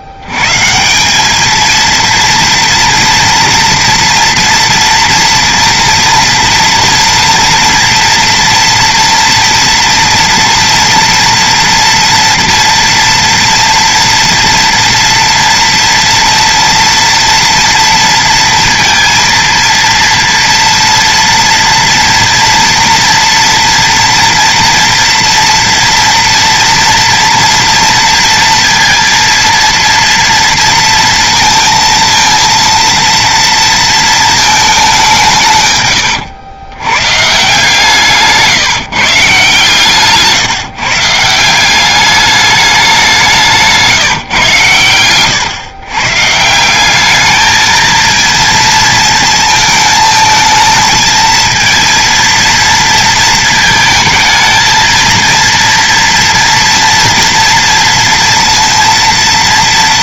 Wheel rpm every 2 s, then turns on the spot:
90, 230, 240, 240, 240, 230, 230, 240, 230, 230, 230, 230, 230, 230, 230, 230, 230, 220, 110, 160, 150, 210, 150, 150, 230, 220, 230, 220, 230, 230.
38-40